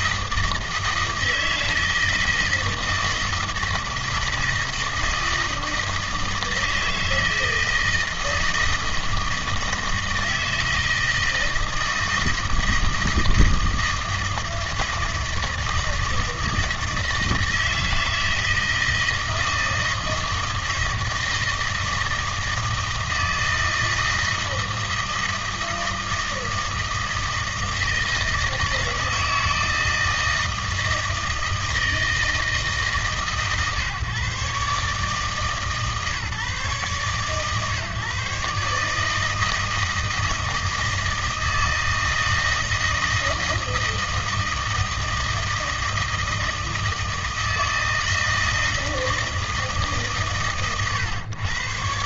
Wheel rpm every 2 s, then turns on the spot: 160, 160, 160, 160, 160, 160, 160, 160, 160, 160, 160, 160, 160, 160, 160, 160, 160, 140, 140, 150, 160, 160, 160, 160, 160, 120.
none